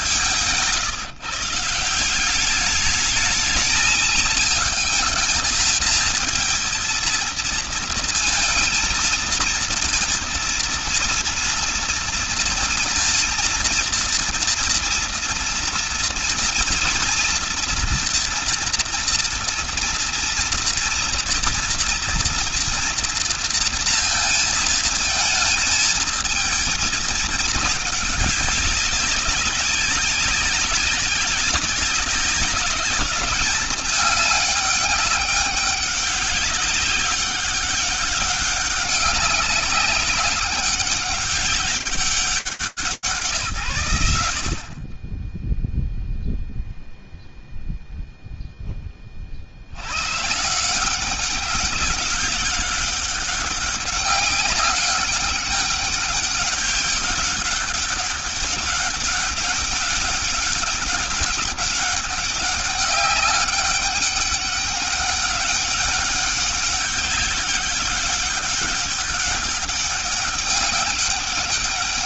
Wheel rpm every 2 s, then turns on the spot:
150, 210, 220, 230, 220, 230, 230, 230, 230, 240, 230, 240, 220, 220, 200, 190, 200, 200, 200, 200, 200, 190, 50, 0, 30, 190, 190, 200, 200, 200, 200, 200, 200, 200, 200, 200.
none